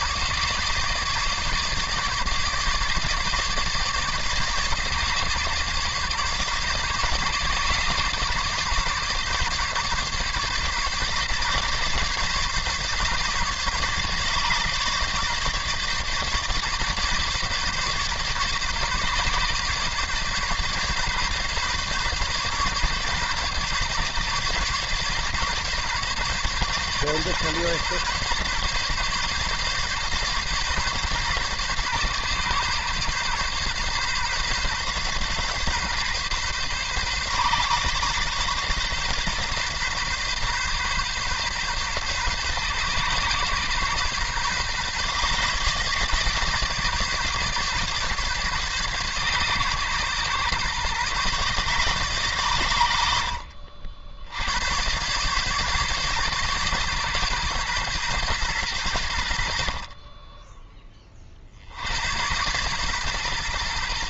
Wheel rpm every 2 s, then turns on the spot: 150, 150, 150, 140, 150, 140, 140, 140, 140, 140, 140, 140, 140, 140, 140, 140, 130, 130, 130, 130, 130, 140, 140, 150, 140, 130, 90, 100, 140, 100, 20, 120.
none